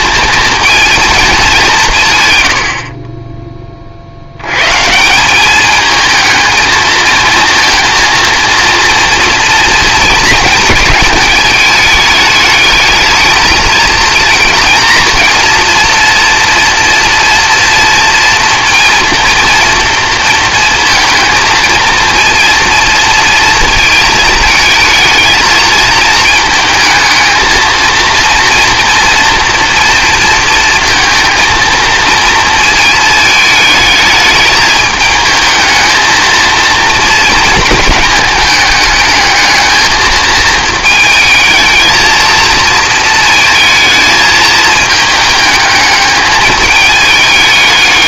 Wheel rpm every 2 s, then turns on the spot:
220, 60, 140, 220, 240, 220, 210, 230, 230, 230, 220, 230, 220, 220, 230, 230, 220, 220, 230, 210, 220, 230, 220, 210.
none